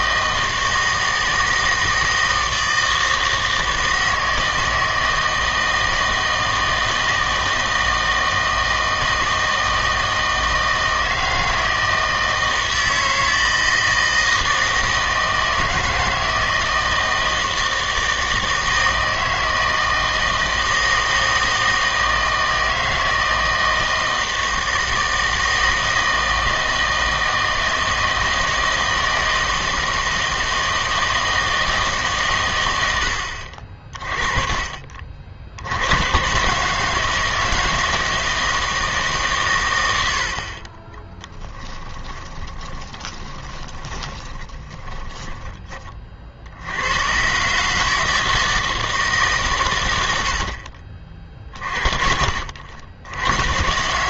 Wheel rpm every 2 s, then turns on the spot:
160, 160, 160, 160, 160, 160, 160, 160, 160, 160, 160, 160, 160, 160, 160, 160, 100, 40, 150, 160, 40, 20, 20, 80, 160, 60, 60.
42-46